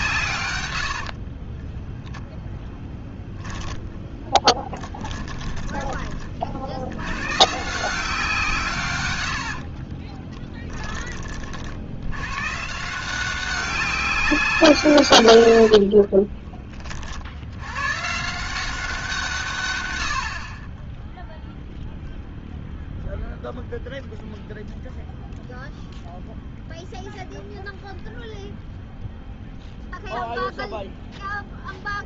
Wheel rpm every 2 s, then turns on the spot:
100, 0, 10, 60, 150, 10, 150, 160, 20, 170, 20, 0, 0, 0, 0, 0.
0-2 4-6